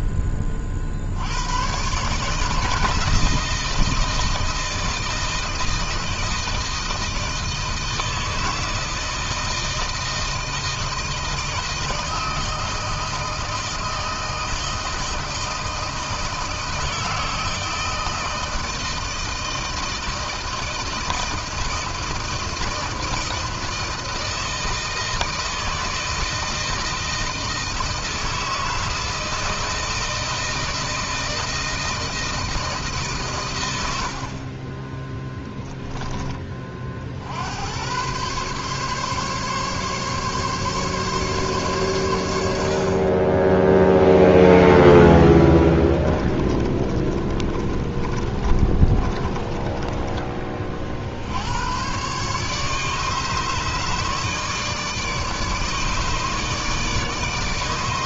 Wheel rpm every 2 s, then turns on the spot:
70, 160, 160, 160, 160, 160, 160, 160, 160, 160, 160, 160, 160, 160, 160, 160, 140, 10, 50, 140, 140, 50, 0, 30, 30, 60, 150, 150, 150.
34-36 46-50